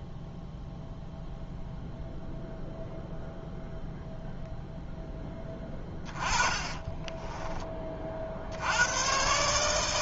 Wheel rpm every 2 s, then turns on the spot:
0, 0, 0, 20, 100.
6-8